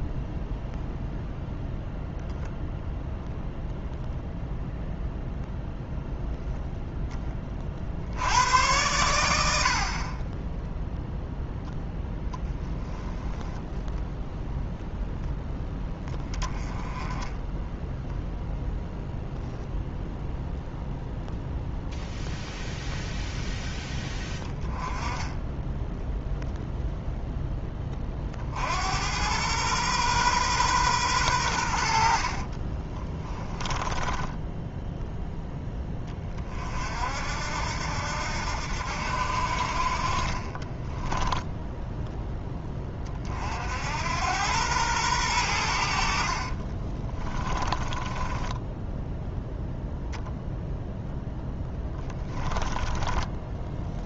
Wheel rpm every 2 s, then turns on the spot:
0, 0, 0, 10, 100, 0, 0, 0, 20, 0, 0, 0, 10, 0, 80, 120, 20, 10, 50, 70, 20, 20, 100, 30, 10, 0, 10.
32-36 40-42 46-50 52-54